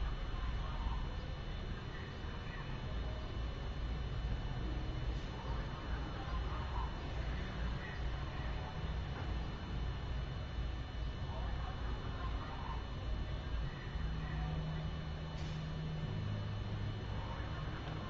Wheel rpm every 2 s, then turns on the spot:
0, 0, 0, 0, 0, 0, 0, 0, 0.
none